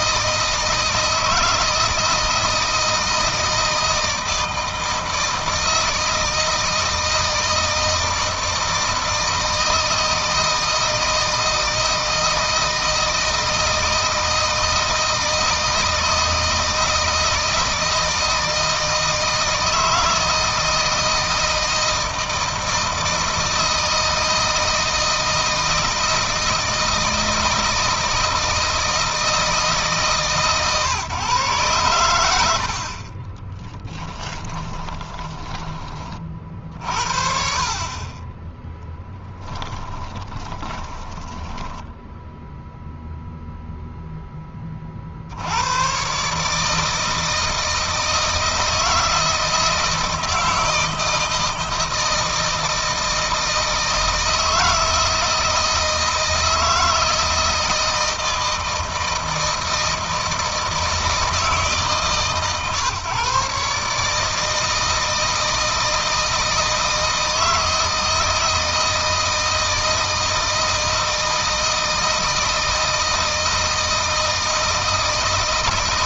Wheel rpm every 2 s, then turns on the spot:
160, 160, 160, 160, 160, 160, 160, 160, 160, 160, 160, 160, 160, 160, 160, 130, 60, 20, 50, 10, 20, 0, 20, 150, 160, 160, 160, 160, 160, 160, 160, 140, 160, 160, 160, 160, 160, 160.
32-36 38-42